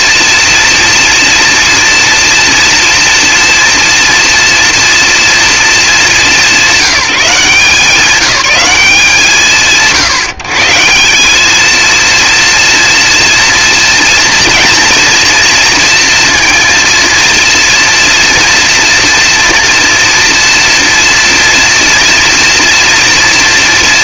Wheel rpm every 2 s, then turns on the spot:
240, 230, 230, 190, 180, 160, 240, 240, 230, 230, 230, 240.
none